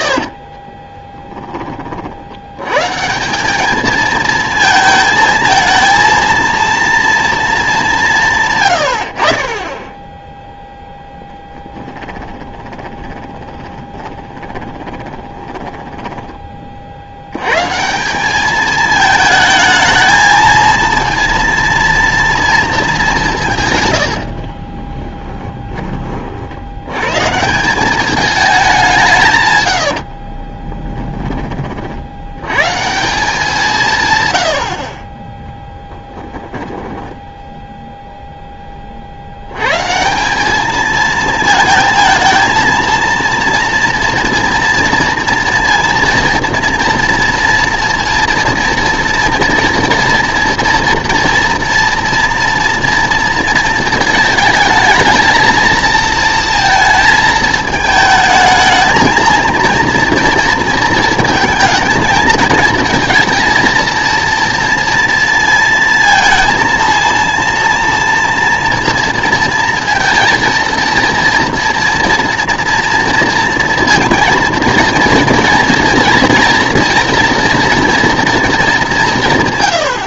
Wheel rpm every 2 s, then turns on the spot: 30, 130, 220, 230, 110, 0, 20, 20, 40, 210, 230, 220, 30, 90, 190, 20, 140, 70, 10, 20, 210, 230, 230, 230, 230, 240, 240, 220, 230, 220, 230, 220, 230, 230, 230, 230, 230, 230, 230, 220.
0-2 12-16 24-26 30-32 36-38